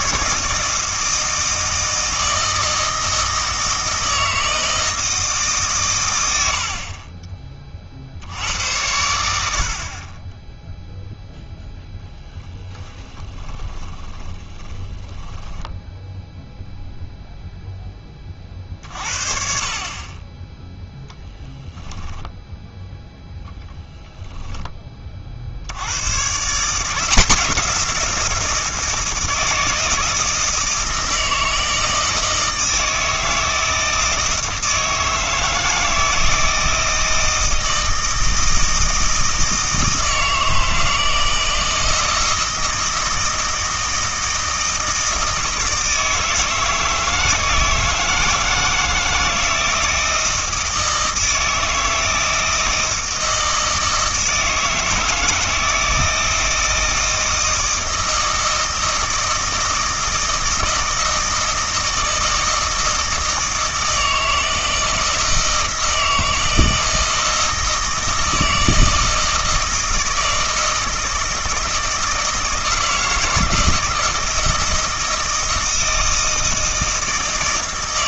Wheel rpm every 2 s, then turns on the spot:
160, 160, 160, 50, 90, 0, 20, 20, 0, 40, 0, 0, 20, 150, 160, 160, 160, 160, 160, 160, 160, 160, 160, 160, 160, 160, 160, 160, 160, 160, 160, 160, 160, 160, 160, 160, 160, 160, 160.
6-8 12-16 24-26